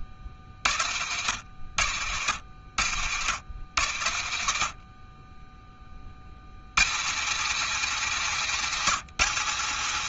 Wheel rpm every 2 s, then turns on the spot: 20, 80, 20, 110, 190.
none